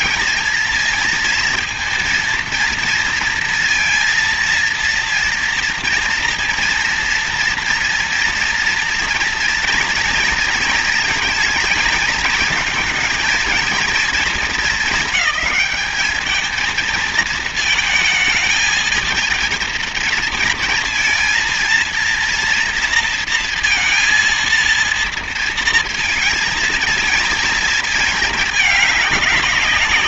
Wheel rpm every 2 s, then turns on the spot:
230, 230, 230, 230, 230, 220, 220, 210, 220, 230, 230, 230, 230, 220, 180.
none